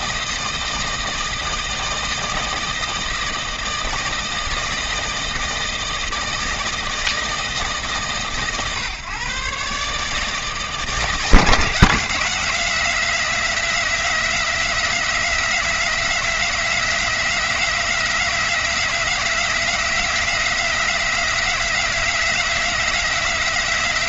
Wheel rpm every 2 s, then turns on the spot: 160, 160, 160, 160, 130, 150, 190, 190, 180, 190, 190, 180.
none